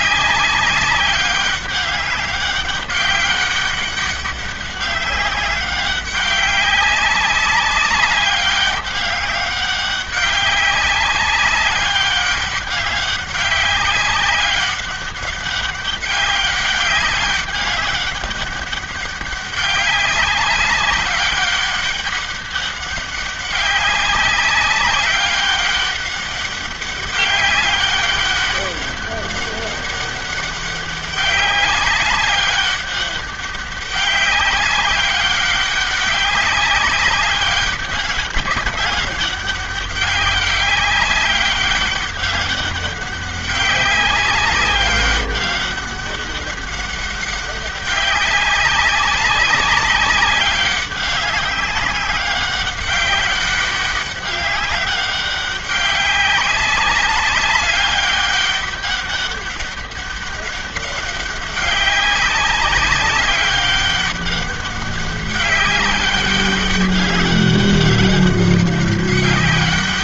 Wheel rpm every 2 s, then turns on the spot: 190, 200, 200, 200, 200, 200, 200, 200, 200, 200, 200, 200, 190, 200, 200, 200, 200, 190, 200, 200, 200, 190, 200, 200, 200, 200, 190, 190, 190, 200, 200, 200, 200, 200, 200.
none